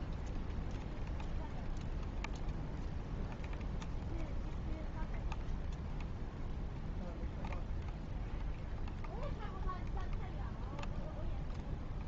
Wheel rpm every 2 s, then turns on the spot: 0, 0, 0, 0, 0, 0.
none